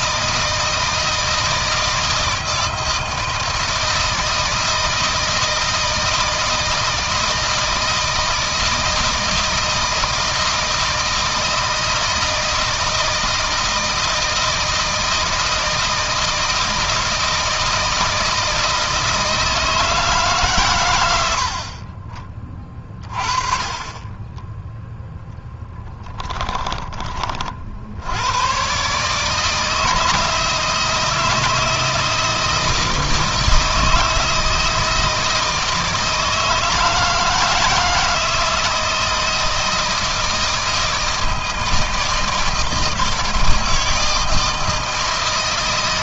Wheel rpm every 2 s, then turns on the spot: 160, 160, 160, 160, 160, 160, 160, 160, 160, 160, 100, 30, 10, 30, 140, 160, 160, 160, 160, 160, 160, 160, 160.
24-26